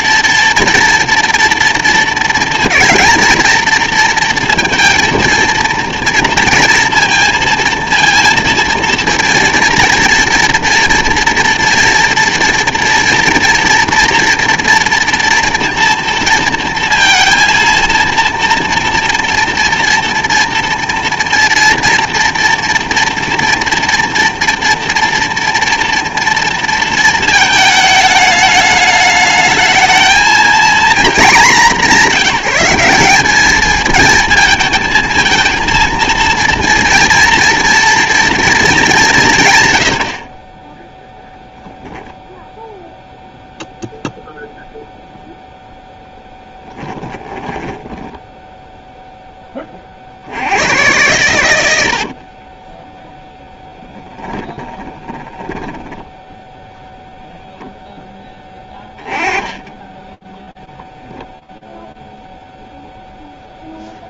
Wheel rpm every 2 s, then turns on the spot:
230, 230, 230, 230, 230, 230, 240, 230, 230, 230, 230, 230, 230, 230, 210, 230, 190, 220, 230, 220, 30, 10, 0, 10, 10, 90, 30, 20, 0, 20, 0, 10.
46-50 52-56